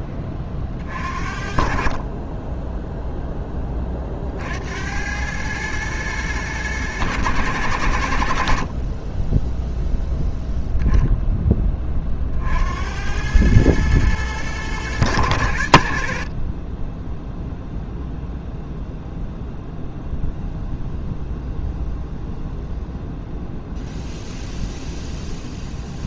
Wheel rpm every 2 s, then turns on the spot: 40, 10, 70, 110, 50, 0, 70, 110, 20, 0, 0, 0, 0.
none